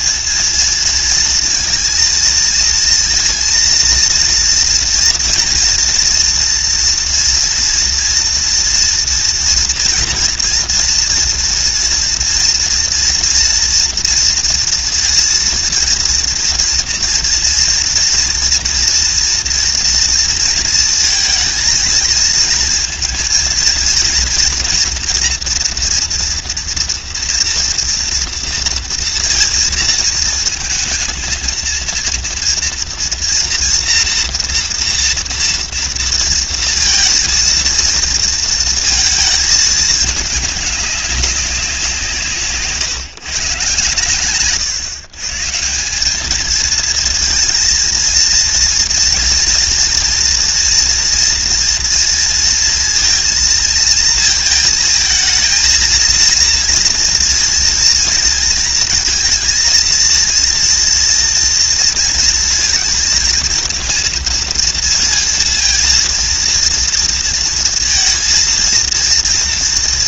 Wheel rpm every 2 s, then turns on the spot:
230, 230, 230, 230, 230, 230, 240, 230, 230, 240, 230, 230, 230, 230, 230, 220, 230, 230, 230, 230, 200, 150, 140, 230, 230, 230, 230, 220, 230, 230, 230, 230, 230, 230, 230.
none